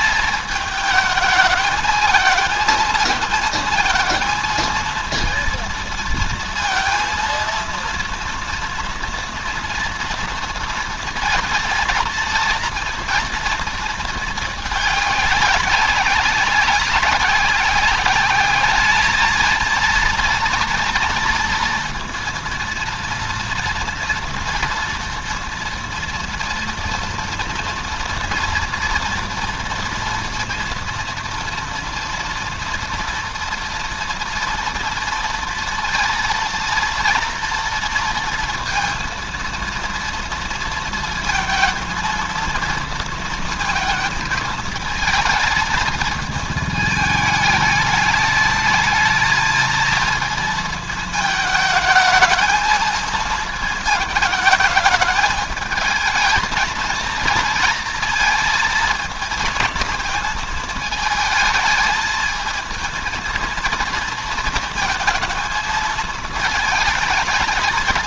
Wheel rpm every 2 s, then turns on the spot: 220, 220, 230, 230, 240, 230, 230, 220, 190, 210, 230, 230, 240, 230, 230, 230, 230, 230, 230, 230, 230, 230, 220, 220, 210, 220, 220, 220, 220, 230, 220, 220, 220, 220.
none